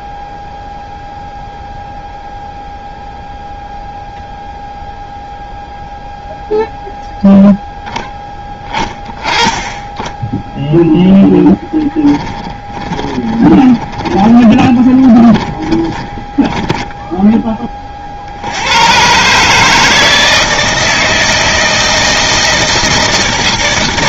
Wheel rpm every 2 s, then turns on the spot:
0, 0, 0, 0, 10, 0, 20, 30, 10, 80, 160, 160.
12-18